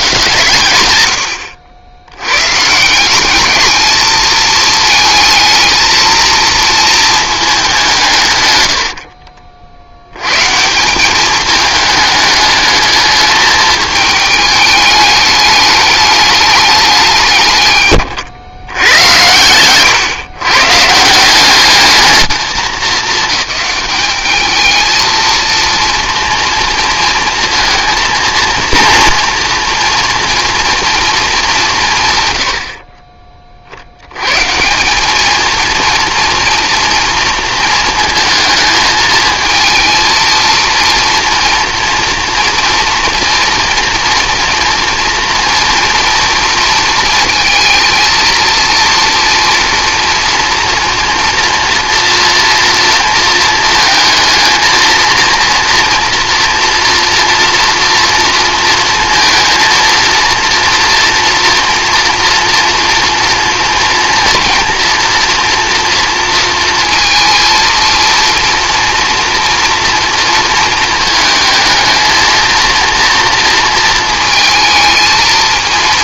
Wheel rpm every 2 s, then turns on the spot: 120, 160, 220, 220, 100, 150, 210, 210, 200, 110, 140, 210, 220, 230, 230, 240, 60, 180, 230, 220, 230, 230, 230, 230, 230, 230, 230, 230, 240, 230, 230, 230, 230, 230, 230, 230, 230, 220.
8-10